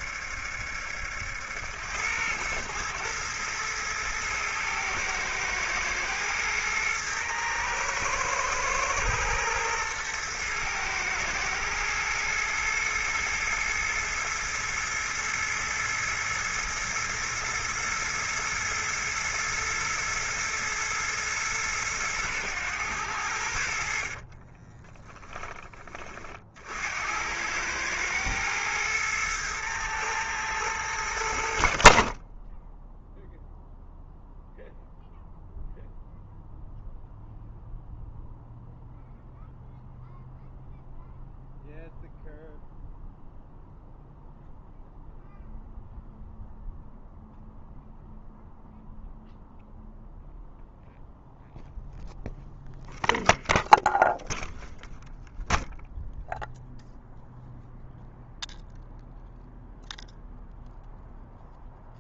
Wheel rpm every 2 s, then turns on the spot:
70, 110, 110, 110, 120, 110, 110, 110, 110, 110, 110, 100, 30, 60, 110, 100, 10, 0, 0, 0, 0, 0, 0, 0, 0, 0, 0, 0, 0, 0, 0.
24-26